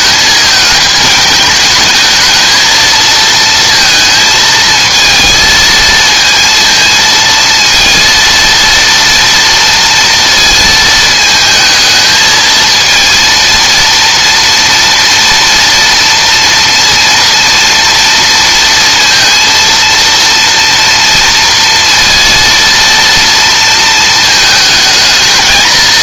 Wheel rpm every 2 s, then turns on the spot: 220, 220, 220, 230, 230, 230, 230, 230, 230, 230, 230, 230, 220.
none